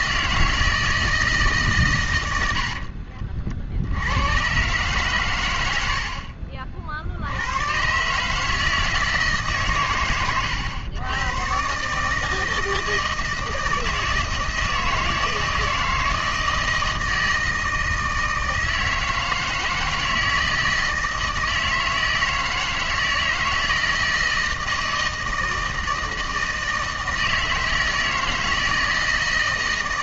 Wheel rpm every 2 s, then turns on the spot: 160, 70, 120, 50, 160, 110, 160, 160, 160, 160, 160, 160, 160, 160, 160.
none